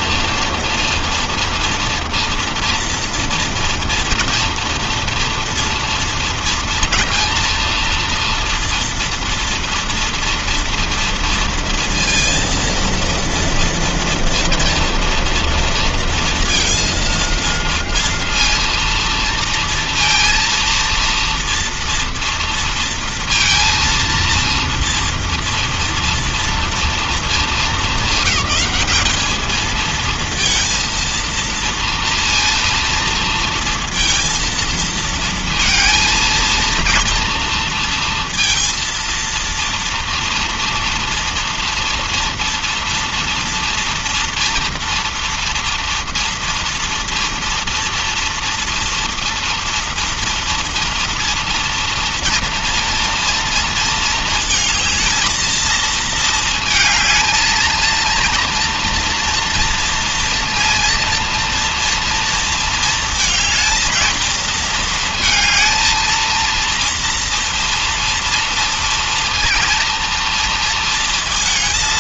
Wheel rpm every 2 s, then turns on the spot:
230, 230, 230, 230, 230, 230, 230, 230, 230, 230, 230, 230, 230, 230, 200, 230, 230, 230, 230, 230, 230, 230, 230, 230, 230, 230, 230, 220, 220, 230, 230, 230, 230, 230, 230, 230.
none